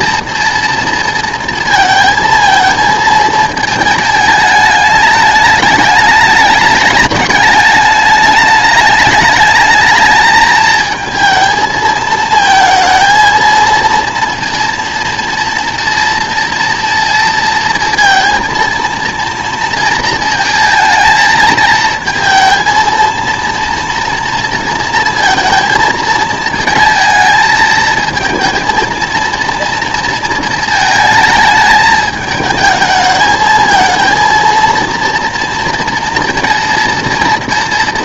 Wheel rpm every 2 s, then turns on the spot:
230, 220, 210, 210, 210, 220, 220, 230, 230, 230, 220, 230, 230, 220, 220, 220, 220, 230, 230.
none